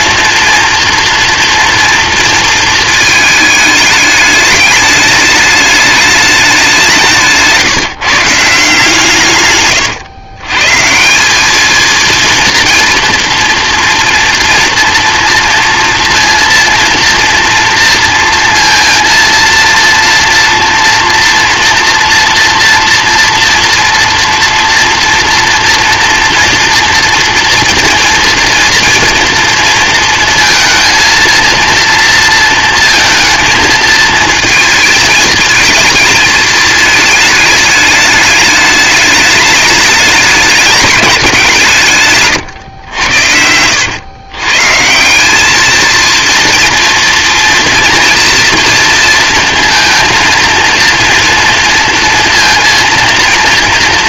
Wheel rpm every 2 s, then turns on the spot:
230, 220, 210, 190, 160, 140, 230, 230, 230, 230, 240, 230, 230, 230, 240, 230, 230, 230, 220, 210, 210, 110, 150, 230, 240, 230, 230.
42-44